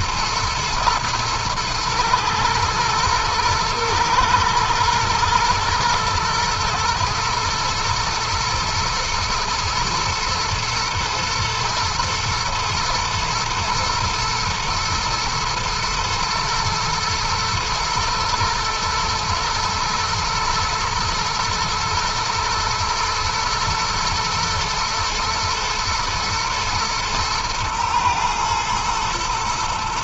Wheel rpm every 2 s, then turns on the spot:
120, 110, 110, 110, 120, 110, 120, 110, 110, 110, 120, 110, 120, 110, 120.
none